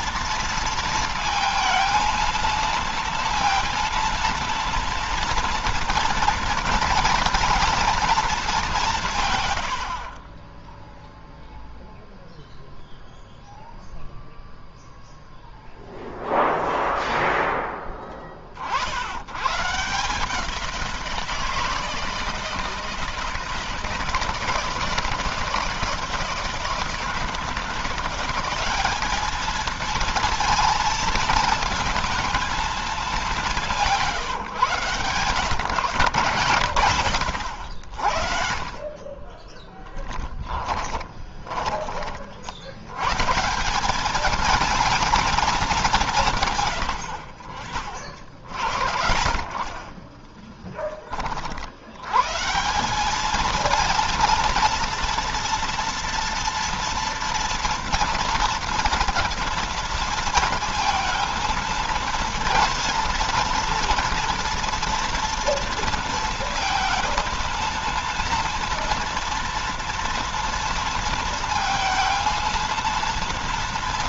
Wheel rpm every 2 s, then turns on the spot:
230, 230, 230, 230, 170, 0, 0, 0, 0, 70, 170, 160, 170, 160, 200, 220, 210, 140, 70, 30, 20, 120, 230, 90, 50, 20, 190, 230, 230, 230, 220, 230, 230, 230, 230, 230, 230.
38-42